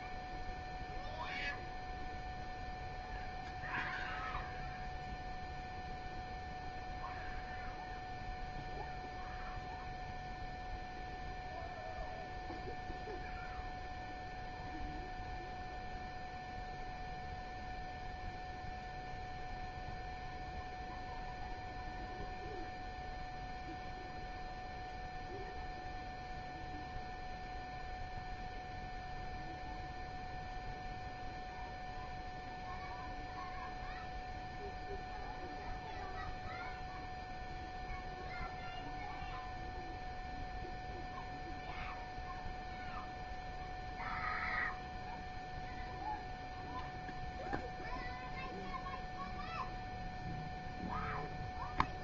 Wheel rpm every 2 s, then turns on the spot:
0, 0, 0, 0, 0, 0, 0, 0, 0, 0, 0, 0, 0, 0, 0, 0, 0, 0, 0, 0, 0, 0, 0, 0, 0, 0.
none